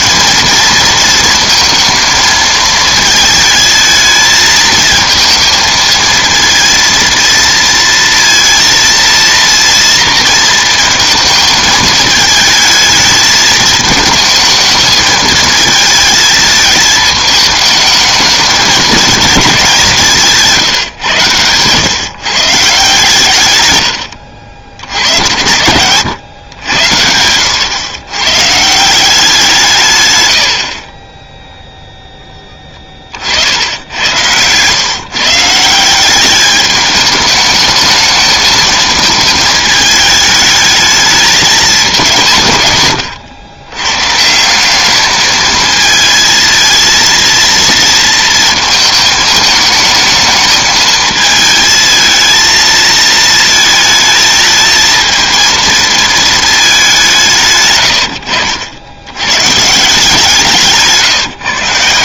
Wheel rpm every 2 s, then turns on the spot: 230, 220, 220, 230, 230, 230, 220, 220, 220, 210, 160, 150, 80, 90, 160, 50, 20, 120, 210, 220, 210, 130, 190, 230, 220, 220, 220, 220, 200, 80, 150.
60-62